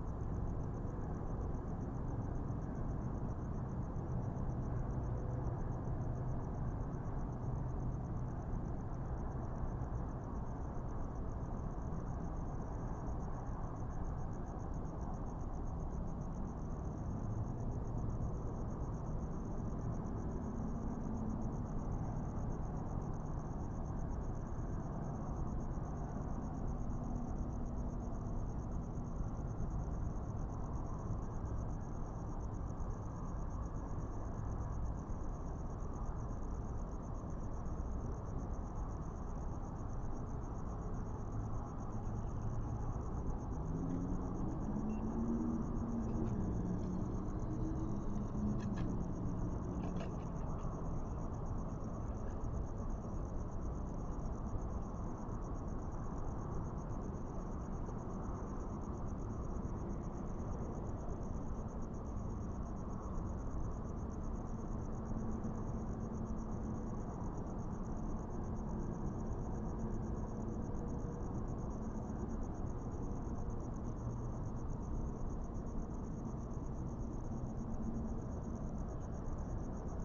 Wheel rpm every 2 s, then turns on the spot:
0, 0, 0, 0, 0, 0, 0, 0, 0, 0, 0, 0, 0, 0, 0, 0, 0, 0, 0, 0, 0, 0, 0, 0, 0, 0, 0, 0, 0, 0, 0, 0, 0, 0, 0, 0, 0, 0, 0, 0.
none